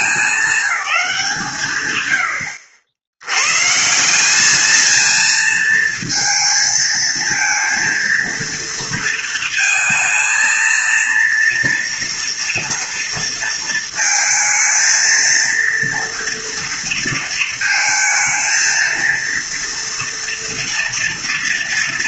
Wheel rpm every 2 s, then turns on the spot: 210, 80, 210, 230, 230, 230, 230, 230, 230, 230, 230.
none